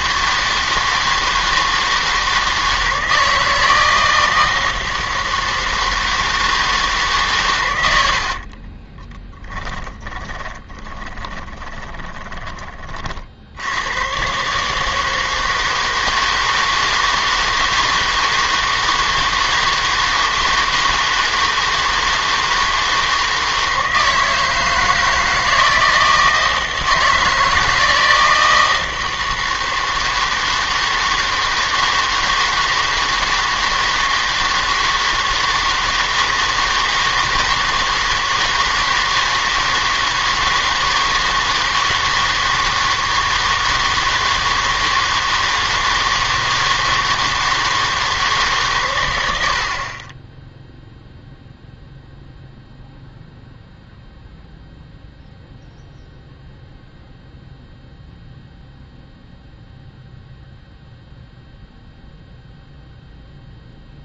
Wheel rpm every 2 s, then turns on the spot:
160, 160, 160, 160, 40, 20, 20, 140, 160, 160, 160, 160, 160, 160, 160, 160, 160, 160, 160, 160, 160, 160, 160, 160, 140, 0, 0, 0, 0, 0, 0, 0.
8-12